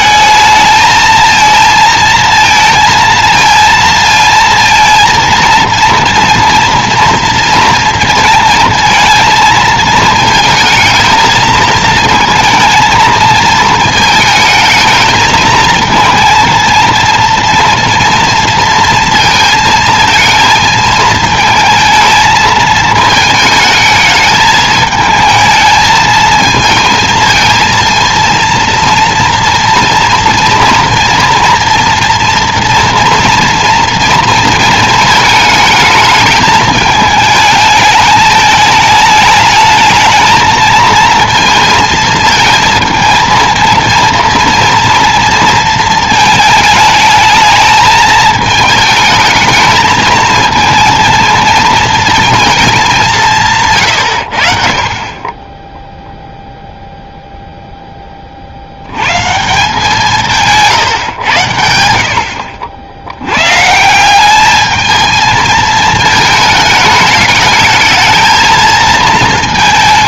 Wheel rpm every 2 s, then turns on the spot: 220, 230, 230, 240, 230, 220, 230, 220, 230, 230, 220, 220, 220, 220, 230, 230, 230, 230, 210, 220, 220, 230, 230, 220, 220, 230, 220, 60, 0, 60, 150, 70, 210, 210, 220.
none